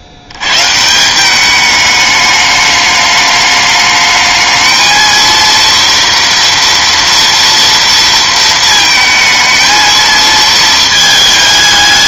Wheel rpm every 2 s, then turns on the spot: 100, 210, 220, 230, 220, 220.
none